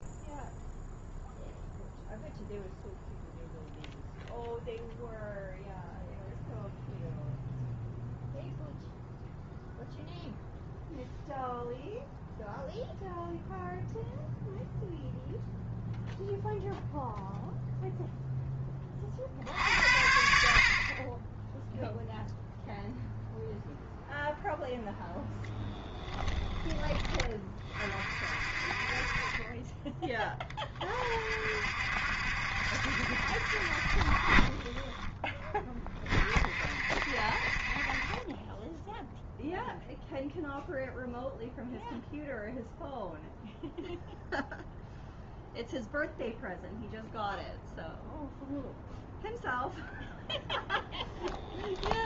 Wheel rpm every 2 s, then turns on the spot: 0, 0, 0, 0, 0, 0, 0, 0, 0, 40, 30, 0, 0, 20, 30, 40, 70, 10, 50, 0, 0, 0, 0, 0, 0, 10.
50-52